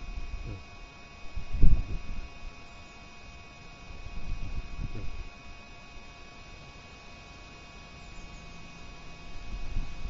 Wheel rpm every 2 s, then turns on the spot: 0, 0, 0, 0, 0.
none